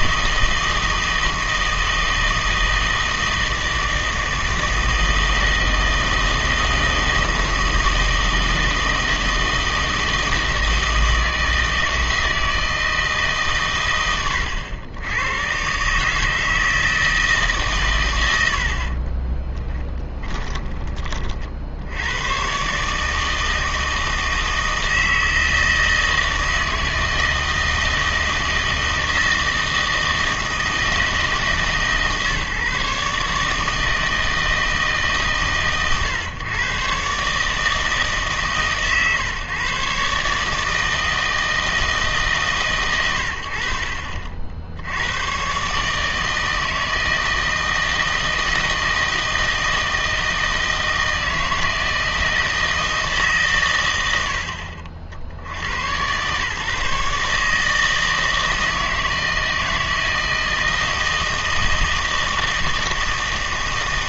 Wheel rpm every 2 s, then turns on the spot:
160, 160, 160, 160, 160, 160, 160, 90, 160, 80, 20, 130, 160, 160, 160, 160, 150, 160, 130, 140, 160, 130, 70, 160, 160, 160, 160, 70, 130, 160, 160, 160.
none